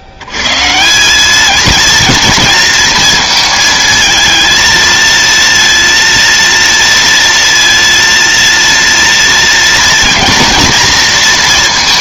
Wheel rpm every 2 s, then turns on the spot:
80, 230, 220, 230, 230, 230.
none